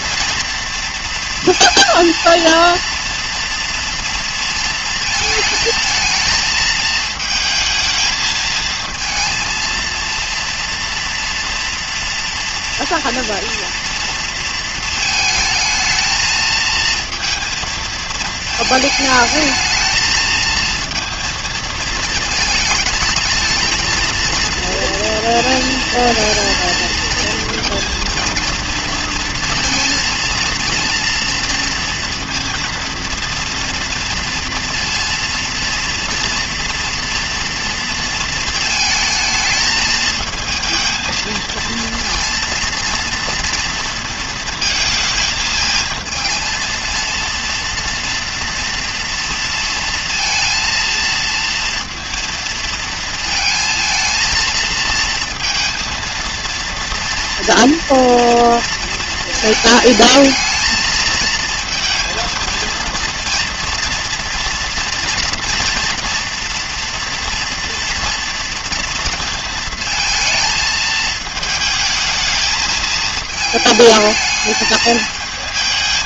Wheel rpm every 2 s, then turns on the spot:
230, 230, 230, 220, 220, 230, 230, 230, 230, 220, 230, 220, 230, 230, 230, 230, 230, 230, 230, 230, 220, 230, 230, 230, 230, 230, 230, 230, 230, 230, 220, 230, 230, 230, 230, 220, 220, 220.
none